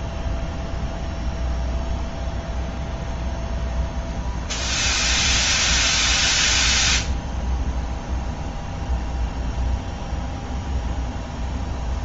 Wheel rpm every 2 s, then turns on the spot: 0, 0, 0, 0, 0, 0.
none